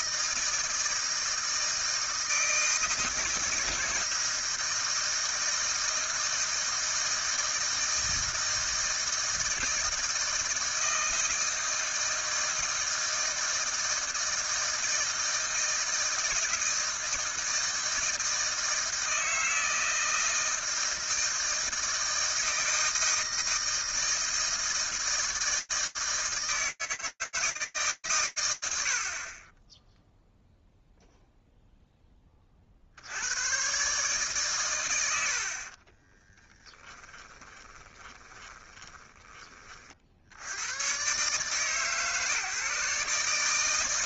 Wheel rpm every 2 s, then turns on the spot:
160, 160, 160, 160, 160, 160, 160, 160, 160, 160, 160, 160, 160, 160, 100, 0, 20, 140, 20, 10, 70, 130.
36-40